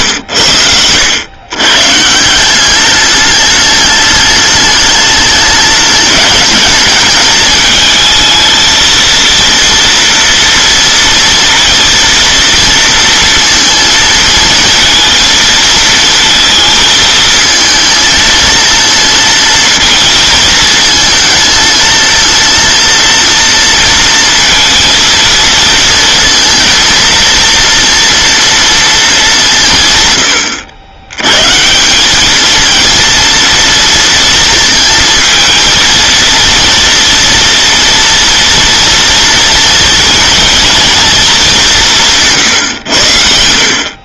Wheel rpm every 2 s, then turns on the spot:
90, 190, 210, 210, 230, 230, 230, 220, 220, 230, 220, 230, 230, 230, 230, 80, 230, 230, 230, 240, 230, 140.
none